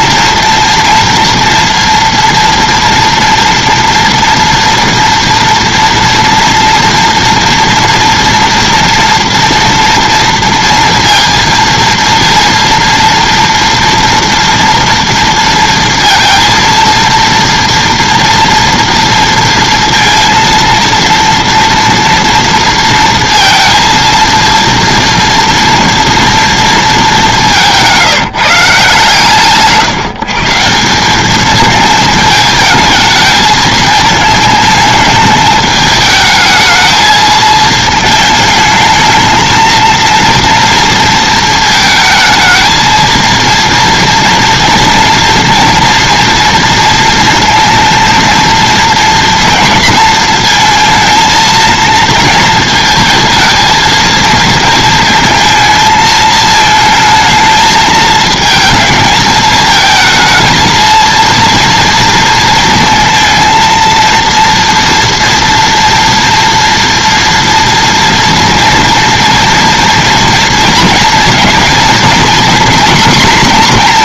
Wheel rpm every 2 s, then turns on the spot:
230, 230, 230, 230, 230, 230, 230, 230, 230, 230, 230, 230, 230, 220, 150, 180, 220, 210, 220, 220, 230, 220, 230, 230, 230, 230, 220, 220, 220, 220, 230, 230, 230, 230, 230, 230, 240.
none